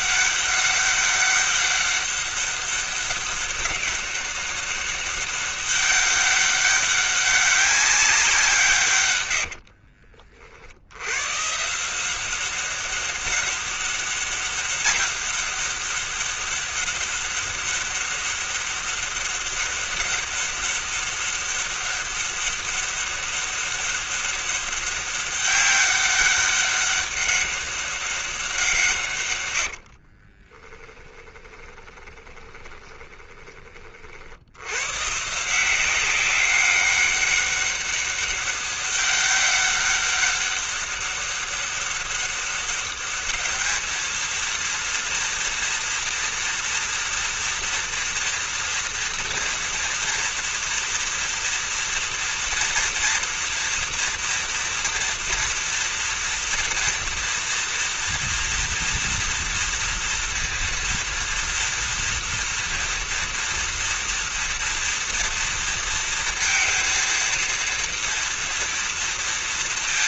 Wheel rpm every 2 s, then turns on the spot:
190, 200, 200, 200, 190, 50, 180, 200, 200, 200, 200, 200, 200, 200, 190, 50, 20, 60, 190, 200, 200, 200, 230, 230, 230, 230, 230, 230, 240, 230, 230, 230, 230, 230, 230.
10-12 30-34